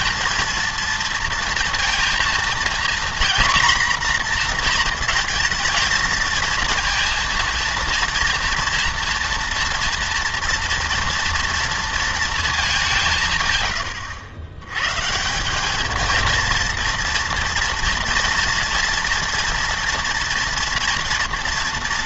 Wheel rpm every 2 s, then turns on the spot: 230, 230, 240, 230, 230, 230, 200, 120, 230, 230, 240.
none